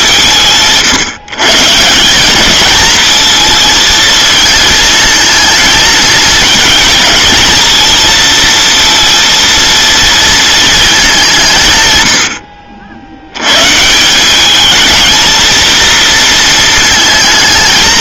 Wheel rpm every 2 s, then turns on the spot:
160, 220, 220, 230, 230, 220, 60, 210, 230.
none